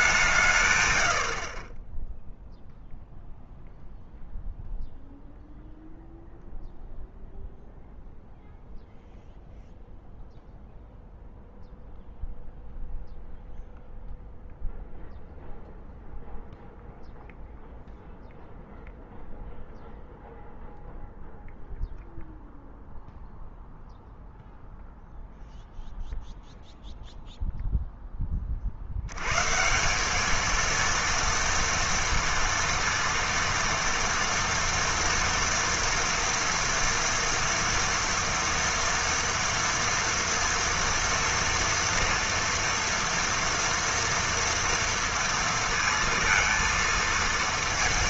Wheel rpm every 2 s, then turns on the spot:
150, 0, 0, 0, 0, 0, 0, 0, 0, 0, 0, 0, 0, 0, 40, 220, 230, 230, 230, 230, 230, 230, 230, 230.
none